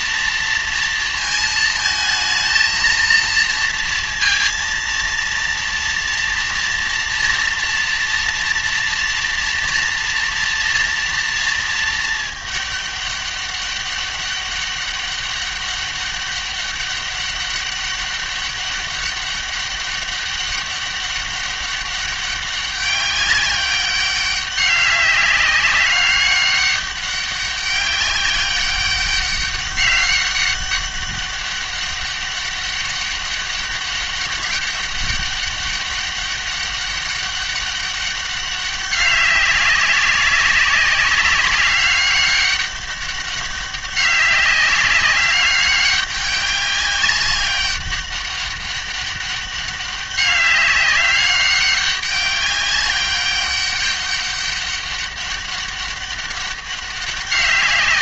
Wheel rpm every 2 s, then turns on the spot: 230, 230, 230, 230, 230, 230, 210, 200, 200, 200, 200, 200, 200, 200, 190, 200, 200, 200, 200, 200, 190, 200, 200, 200, 200, 200, 200, 200, 200.
none